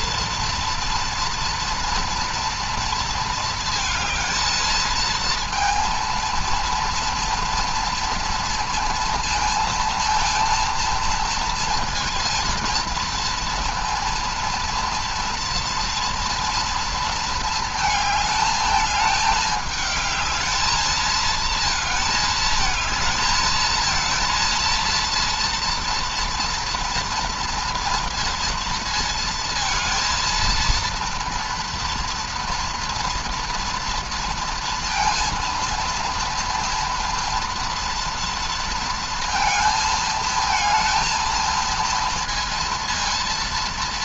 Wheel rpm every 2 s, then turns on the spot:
230, 230, 230, 240, 230, 230, 230, 230, 230, 220, 220, 220, 230, 230, 230, 230, 240, 230, 230, 230, 220, 230.
none